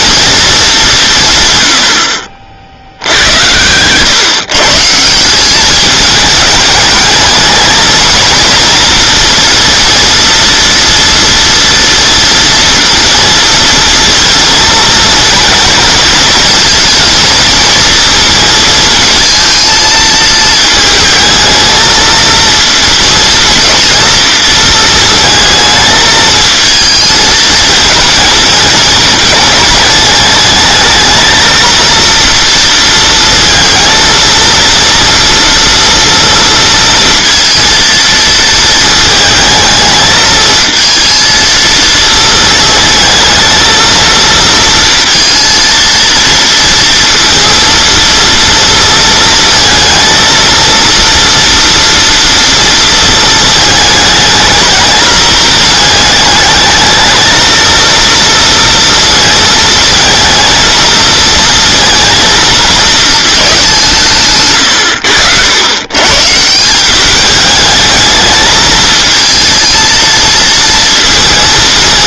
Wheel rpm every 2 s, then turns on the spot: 210, 60, 150, 210, 230, 230, 230, 230, 230, 220, 220, 230, 220, 220, 210, 210, 230, 230, 230, 220, 230, 220, 230, 230, 230, 230, 230, 220, 220, 230, 220, 220, 120, 170, 220, 220.
none